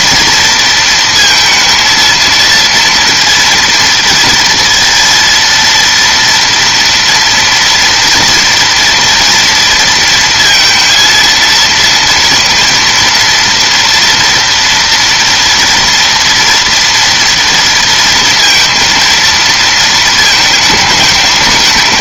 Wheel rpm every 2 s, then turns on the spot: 230, 230, 230, 230, 230, 230, 230, 240, 230, 230, 220.
none